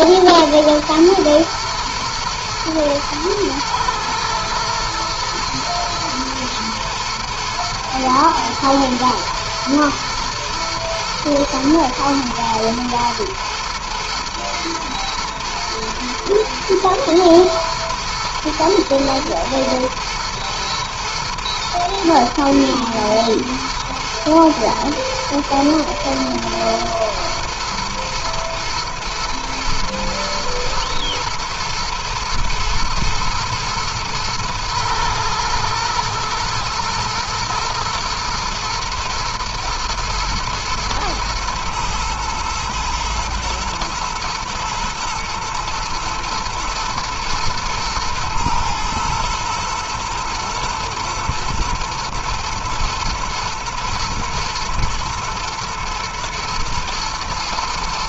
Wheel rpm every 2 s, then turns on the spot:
120, 110, 110, 110, 110, 120, 110, 120, 110, 110, 110, 120, 110, 110, 120, 120, 110, 110, 110, 120, 110, 110, 110, 110, 110, 120, 110, 110, 120.
none